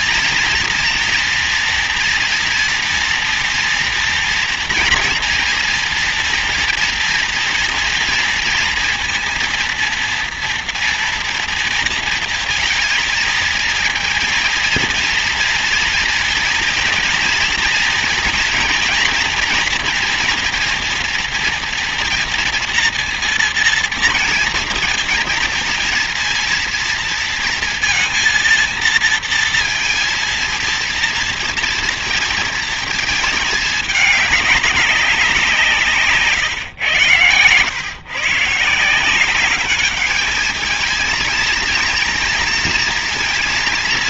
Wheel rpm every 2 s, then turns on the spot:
230, 230, 230, 230, 230, 240, 230, 230, 230, 230, 230, 230, 220, 230, 230, 230, 220, 200, 110, 170, 220, 230.
none